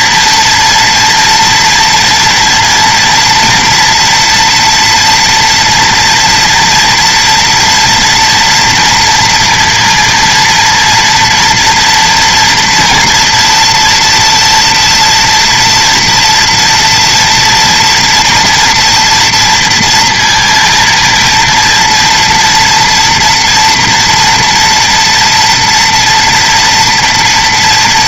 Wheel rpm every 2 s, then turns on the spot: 230, 230, 230, 230, 230, 230, 230, 230, 230, 230, 230, 240, 230, 240.
none